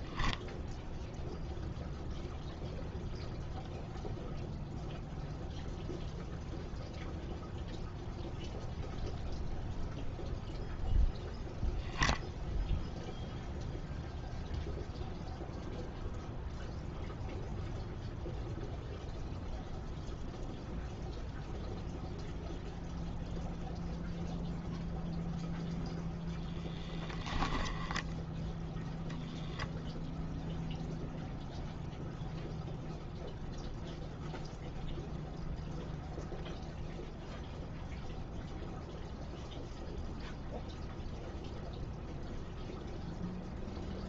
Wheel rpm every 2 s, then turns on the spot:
0, 0, 0, 0, 0, 0, 0, 0, 0, 0, 0, 0, 0, 10, 0, 0, 0, 0, 0, 0, 0, 0.
26-28